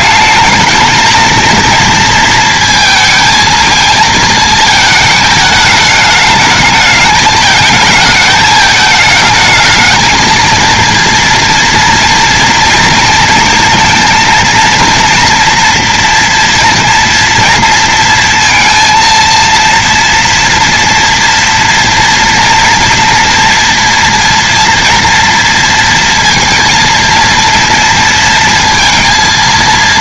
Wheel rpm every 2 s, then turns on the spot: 210, 220, 220, 210, 220, 220, 230, 230, 230, 230, 230, 230, 240, 230, 230.
none